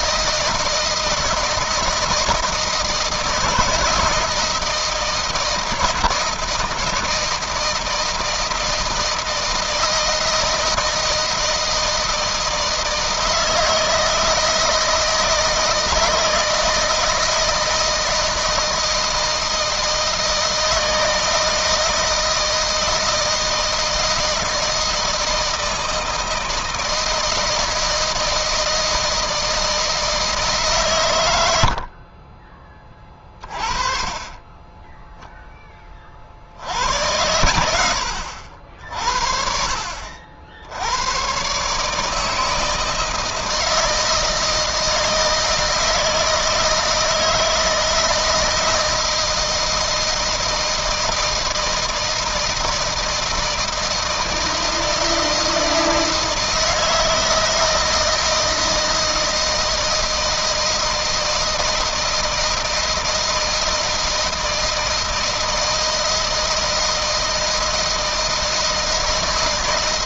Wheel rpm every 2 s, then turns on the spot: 160, 170, 170, 160, 160, 160, 160, 160, 160, 160, 160, 160, 160, 160, 160, 150, 30, 10, 70, 70, 90, 160, 160, 160, 160, 160, 160, 160, 160, 160, 160, 160, 160, 160, 160.
34-36